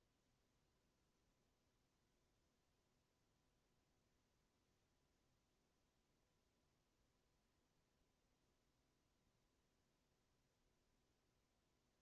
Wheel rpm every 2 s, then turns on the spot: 0, 0, 0, 0, 0, 0.
none